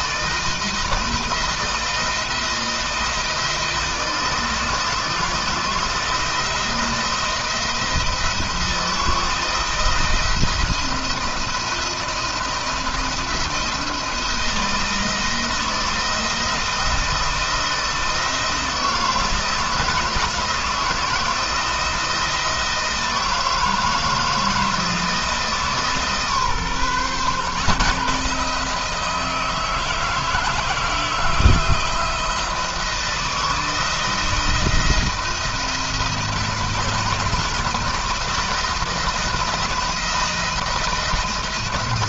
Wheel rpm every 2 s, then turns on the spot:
170, 170, 160, 170, 160, 170, 170, 170, 170, 170, 160, 160, 160, 140, 160, 160, 160, 170, 160, 160, 170.
none